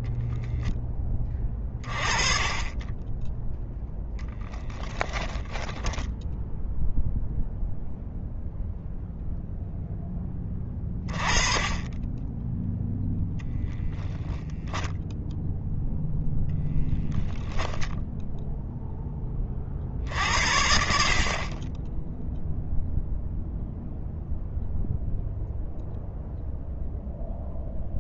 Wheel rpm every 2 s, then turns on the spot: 10, 20, 10, 0, 0, 20, 10, 0, 0, 0, 60, 0, 0, 0.
4-6